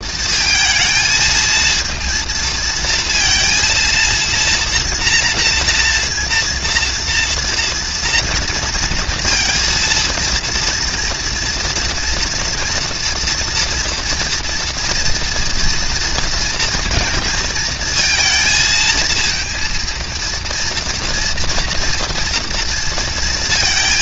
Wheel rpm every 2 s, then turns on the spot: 220, 230, 230, 230, 230, 230, 230, 240, 230, 220, 230, 230.
none